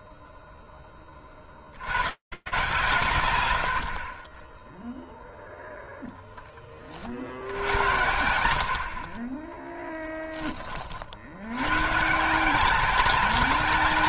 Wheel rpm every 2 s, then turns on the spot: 20, 130, 0, 80, 20, 130, 200.
none